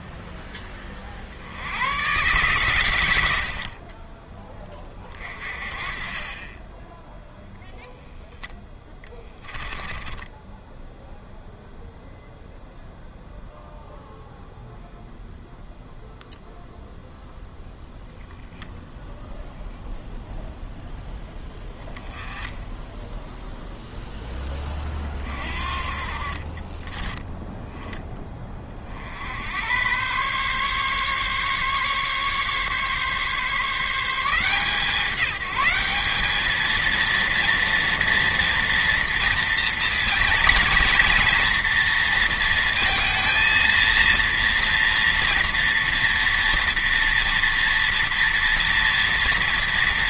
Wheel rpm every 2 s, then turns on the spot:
20, 100, 30, 10, 10, 0, 0, 0, 0, 0, 0, 10, 30, 20, 50, 140, 140, 180, 230, 240, 230, 230, 230, 230, 230.
8-10 26-28